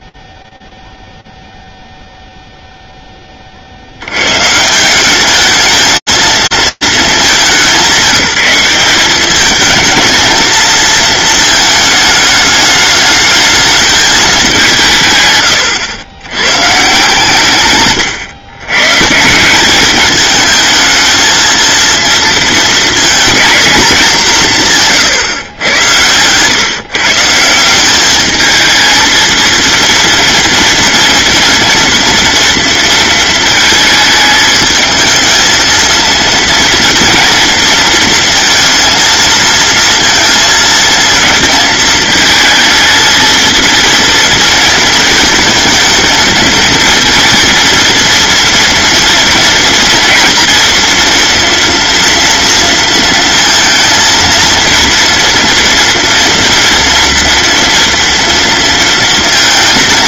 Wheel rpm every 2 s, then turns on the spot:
0, 0, 160, 210, 190, 220, 210, 170, 140, 130, 220, 230, 150, 150, 220, 230, 230, 220, 230, 230, 220, 220, 220, 230, 240, 240, 230, 230, 230, 230.
24-26